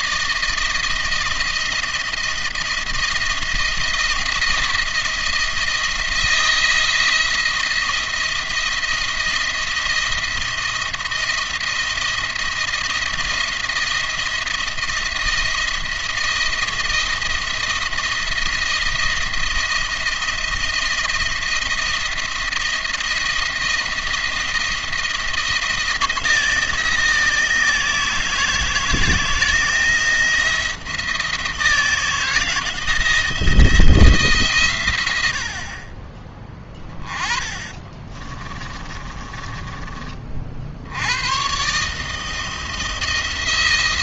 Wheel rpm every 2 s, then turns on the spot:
160, 170, 170, 170, 170, 170, 170, 170, 170, 170, 170, 170, 170, 160, 160, 170, 170, 130, 20, 30, 60, 160.
38-40